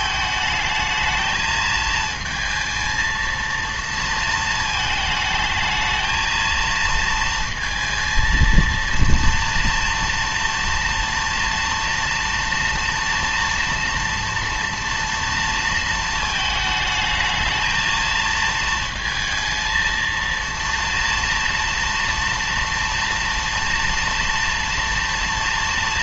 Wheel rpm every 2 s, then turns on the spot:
220, 220, 220, 230, 230, 230, 230, 230, 220, 230, 230, 230, 230.
none